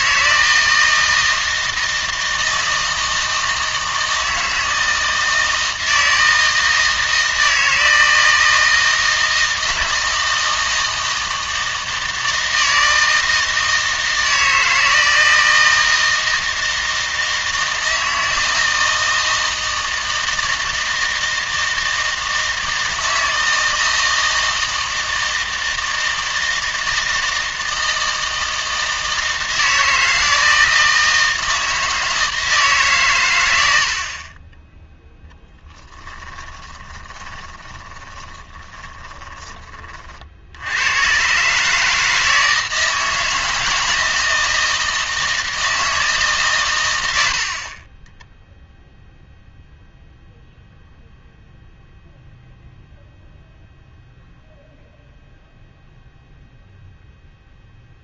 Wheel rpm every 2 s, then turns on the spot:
160, 160, 160, 160, 160, 160, 160, 160, 160, 160, 160, 160, 160, 160, 160, 160, 150, 20, 10, 10, 80, 160, 160, 120, 0, 0, 0, 0, 0.
36-40